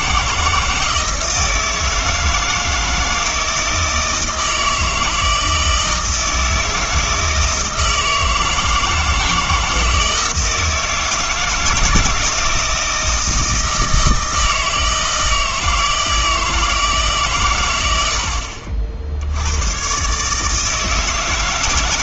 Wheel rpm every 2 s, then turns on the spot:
160, 160, 160, 160, 160, 160, 160, 160, 160, 60, 150.
none